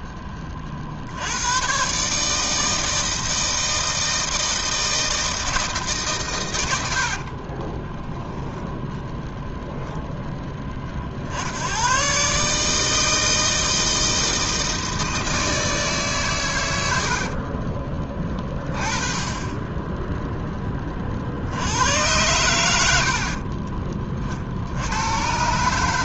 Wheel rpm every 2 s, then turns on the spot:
50, 160, 160, 80, 0, 30, 150, 160, 90, 20, 20, 90, 70.
none